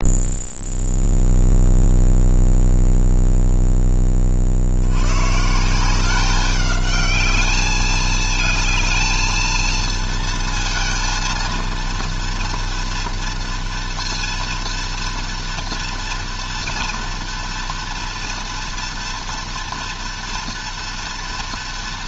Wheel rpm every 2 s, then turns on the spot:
0, 0, 110, 210, 220, 230, 230, 230, 230, 230, 230.
none